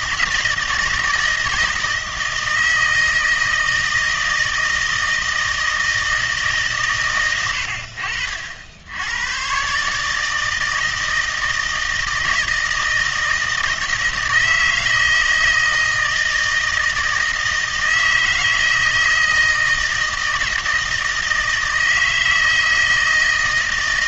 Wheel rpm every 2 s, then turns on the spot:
160, 160, 160, 140, 80, 160, 160, 160, 160, 160, 160, 160.
none